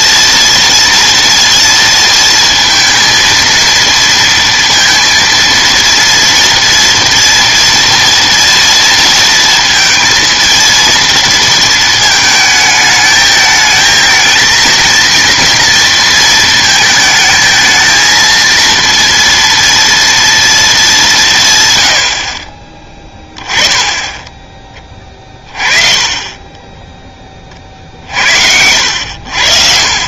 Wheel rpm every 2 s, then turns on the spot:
230, 230, 230, 230, 230, 230, 220, 230, 220, 230, 220, 30, 20, 20, 80.
28-30